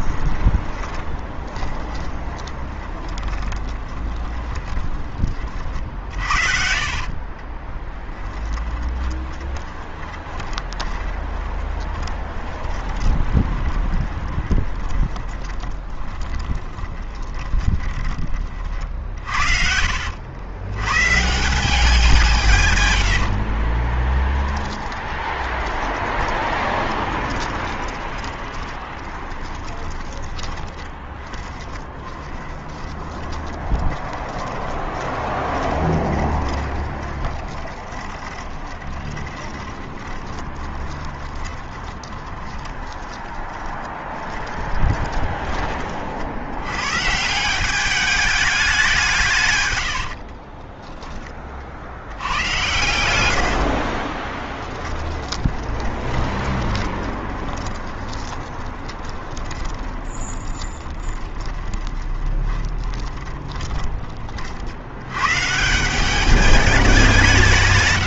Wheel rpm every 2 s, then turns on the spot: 20, 20, 20, 70, 20, 20, 20, 20, 20, 40, 110, 130, 10, 30, 10, 20, 20, 20, 20, 20, 20, 20, 20, 100, 190, 20, 100, 10, 20, 20, 20, 20, 60, 200.
0-20 24-46 50-52 54-64